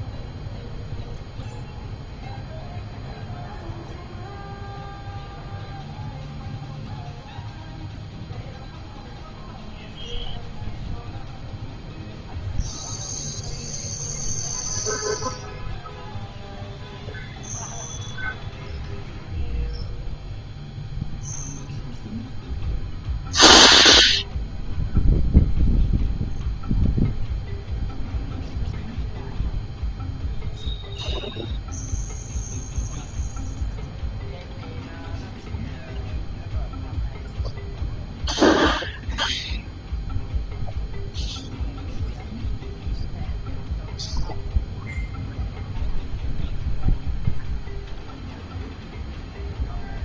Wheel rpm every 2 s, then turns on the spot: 0, 0, 0, 0, 0, 0, 0, 0, 0, 0, 0, 0, 0, 0, 0, 0, 0, 0, 0, 0, 0, 0, 0, 0, 0.
none